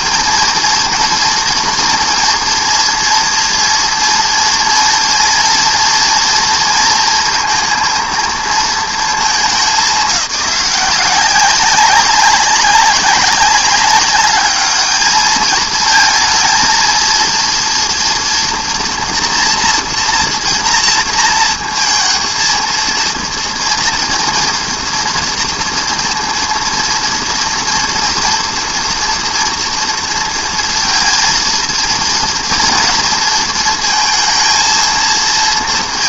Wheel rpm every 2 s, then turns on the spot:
240, 230, 230, 230, 230, 190, 190, 210, 230, 230, 230, 230, 230, 230, 230, 230, 230, 230.
none